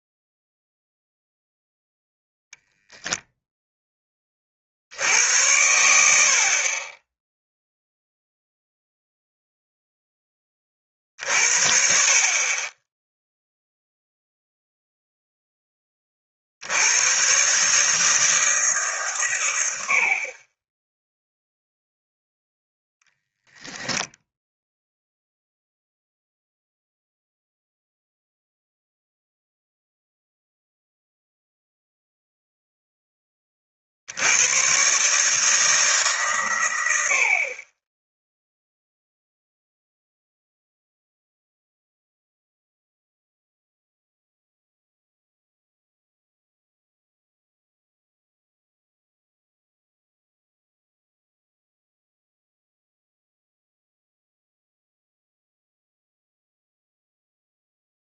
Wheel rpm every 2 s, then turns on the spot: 0, 0, 70, 20, 0, 30, 10, 0, 90, 150, 10, 0, 0, 0, 0, 0, 0, 130, 90, 0, 0, 0, 0, 0, 0, 0, 0, 0, 0.
none